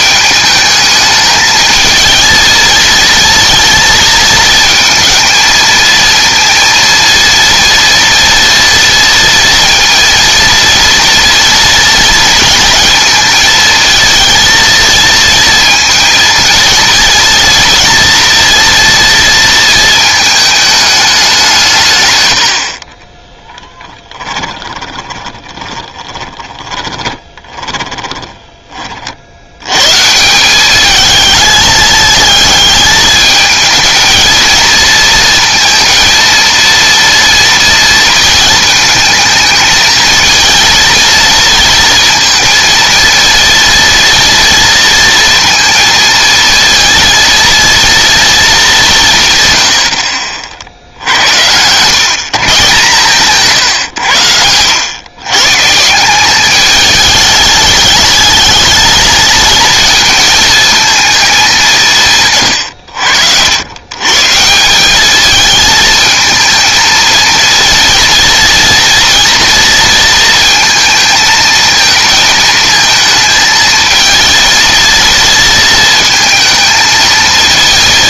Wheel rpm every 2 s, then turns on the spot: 220, 230, 230, 230, 230, 240, 230, 230, 230, 240, 220, 70, 20, 20, 20, 200, 220, 230, 230, 220, 230, 230, 230, 230, 190, 60, 140, 110, 200, 220, 220, 120, 170, 220, 230, 230, 220, 230, 220.
24-28